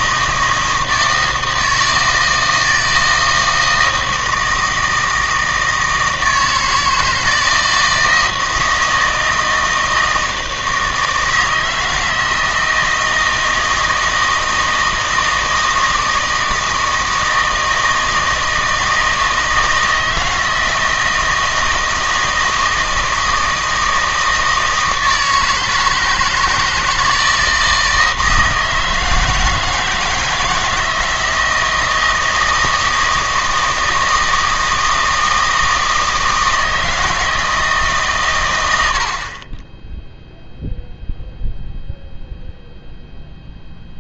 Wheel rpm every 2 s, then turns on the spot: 160, 160, 160, 160, 160, 160, 160, 160, 160, 160, 160, 160, 160, 160, 160, 160, 160, 160, 160, 90, 0, 0.
none